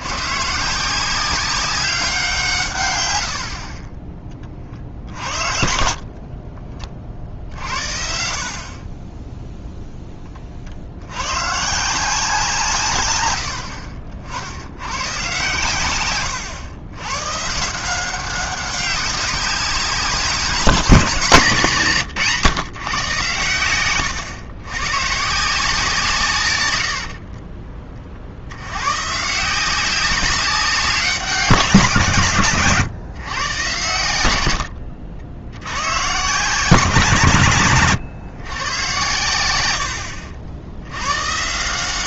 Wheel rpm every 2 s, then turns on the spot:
150, 140, 40, 30, 40, 40, 160, 80, 110, 190, 190, 130, 110, 120, 90, 200, 140, 80, 150, 120, 80.
6-8 32-34